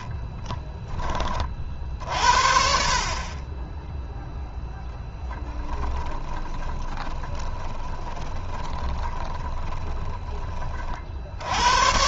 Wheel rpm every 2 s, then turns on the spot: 30, 40, 10, 20, 20, 50.
6-10